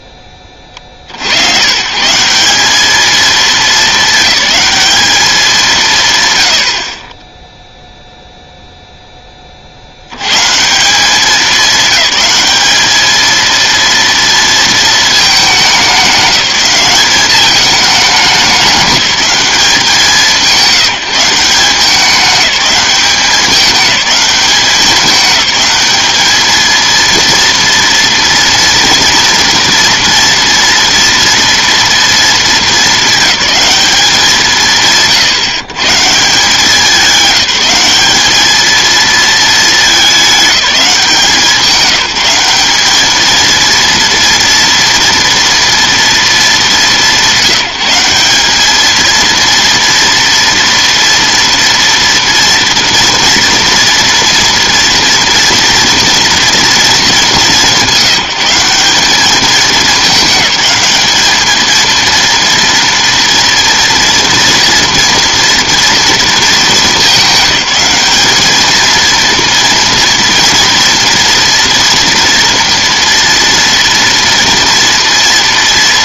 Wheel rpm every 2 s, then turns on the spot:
30, 200, 210, 90, 0, 140, 210, 230, 200, 200, 180, 200, 200, 220, 240, 230, 220, 160, 180, 220, 200, 200, 230, 200, 210, 230, 230, 230, 230, 190, 200, 230, 230, 220, 220, 230, 230, 230.
none